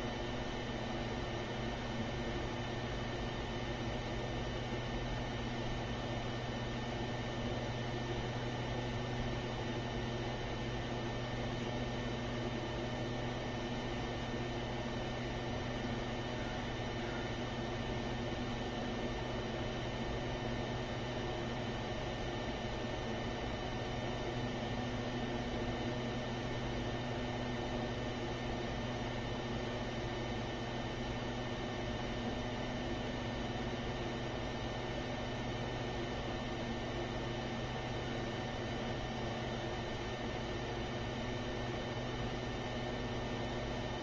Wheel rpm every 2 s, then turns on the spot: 0, 0, 0, 0, 0, 0, 0, 0, 0, 0, 0, 0, 0, 0, 0, 0, 0, 0, 0, 0, 0, 0.
none